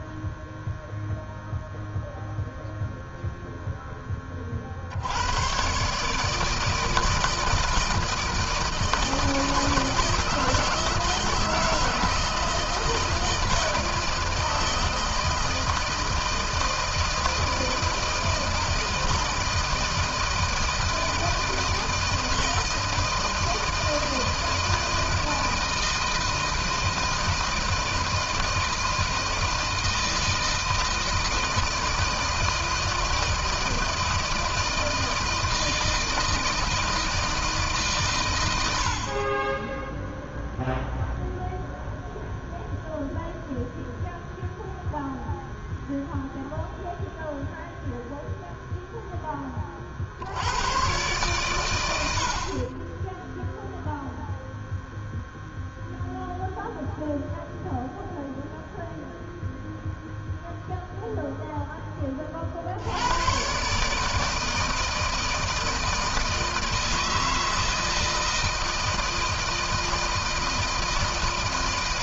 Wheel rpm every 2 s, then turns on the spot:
0, 0, 40, 160, 160, 160, 160, 160, 160, 160, 160, 160, 160, 160, 160, 160, 160, 160, 160, 90, 0, 0, 0, 0, 0, 90, 50, 0, 0, 0, 0, 50, 160, 160, 160, 160.
none